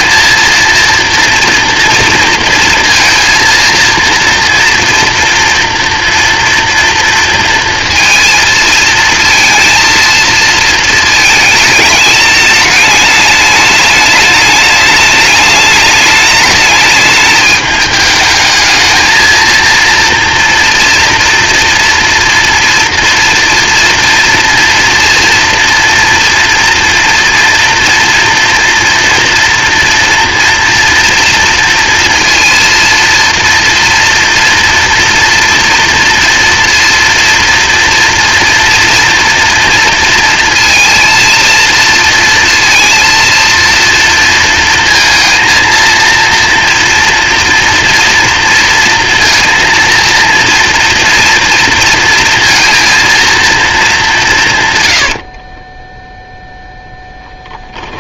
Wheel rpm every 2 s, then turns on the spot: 230, 230, 240, 230, 220, 220, 210, 210, 220, 220, 230, 240, 230, 240, 230, 230, 230, 230, 230, 230, 230, 230, 230, 230, 230, 230, 230, 60, 0.
54-56